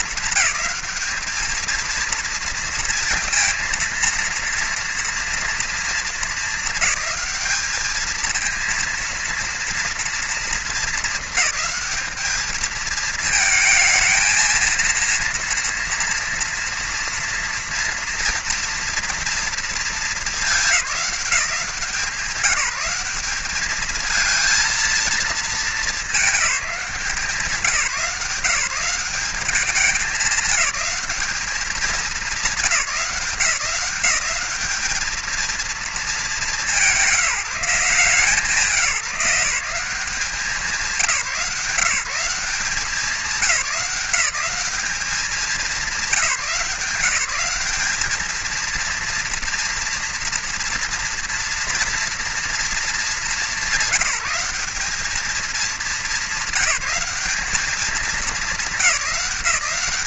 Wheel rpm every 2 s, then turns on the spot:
220, 230, 230, 210, 230, 220, 220, 230, 230, 230, 200, 210, 230, 190, 180, 210, 180, 220, 200, 170, 180, 200, 200, 180, 230, 230, 210, 210, 200, 190.
none